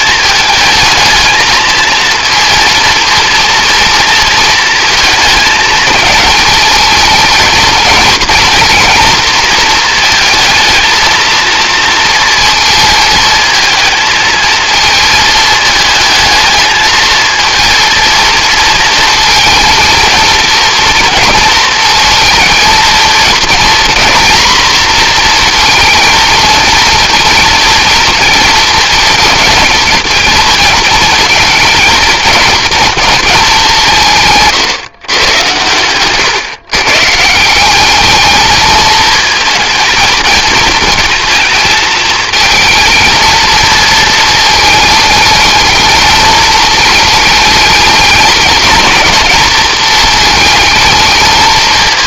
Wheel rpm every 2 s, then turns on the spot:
220, 230, 220, 220, 240, 230, 230, 220, 220, 230, 230, 220, 230, 230, 230, 230, 230, 130, 140, 220, 220, 230, 220, 220, 230, 220.
none